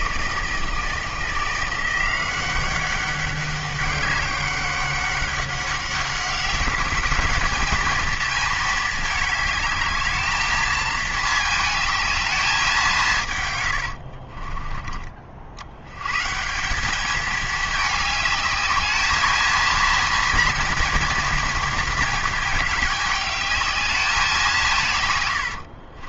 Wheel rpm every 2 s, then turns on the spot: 160, 190, 200, 200, 220, 220, 200, 30, 180, 210, 230, 210, 170.
14-16